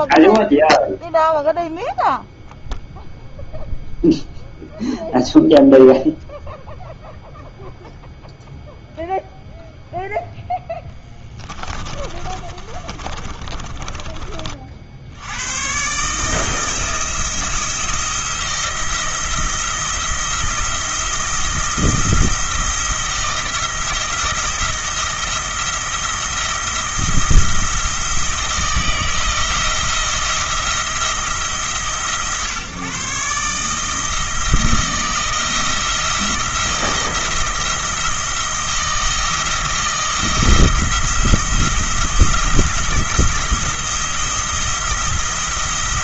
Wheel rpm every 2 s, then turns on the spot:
0, 0, 0, 0, 0, 10, 30, 60, 160, 170, 170, 170, 170, 170, 160, 170, 140, 160, 160, 160, 170, 170, 170.
10-14